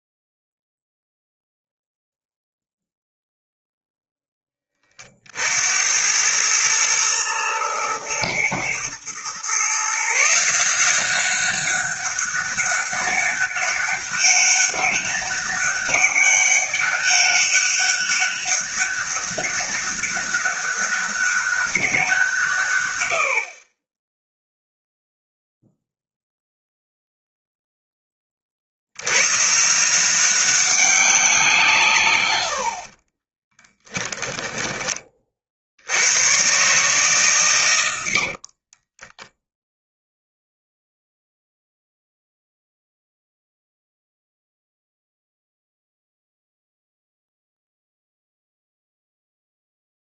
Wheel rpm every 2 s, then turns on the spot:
0, 0, 20, 110, 110, 170, 200, 200, 200, 200, 200, 120, 0, 0, 70, 190, 60, 20, 130, 30, 0, 0, 0, 0, 0.
32-34 38-40